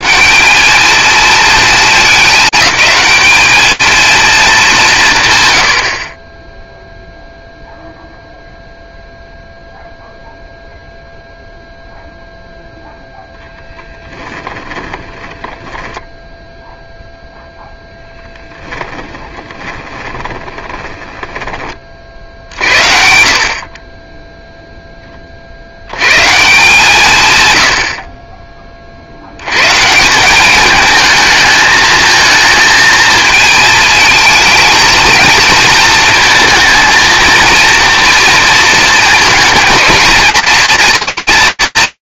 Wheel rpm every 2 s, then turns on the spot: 230, 210, 170, 0, 0, 0, 0, 10, 0, 10, 20, 60, 30, 130, 80, 220, 220, 230, 230, 220, 230.
14-16 18-22